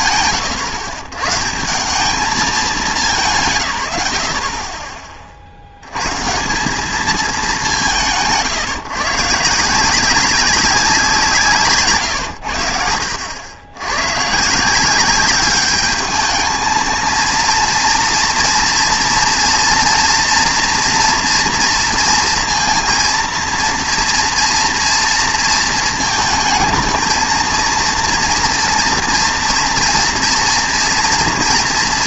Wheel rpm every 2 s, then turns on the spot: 130, 200, 40, 180, 150, 190, 80, 160, 220, 240, 230, 230, 230, 220, 230, 230.
none